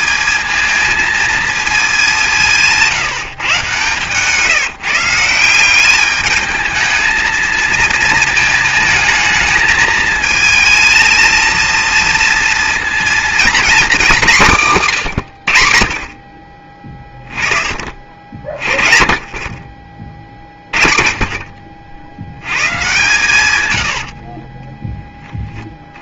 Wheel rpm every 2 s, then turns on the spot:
230, 170, 160, 210, 230, 220, 230, 190, 40, 30, 40, 120, 30.
24-26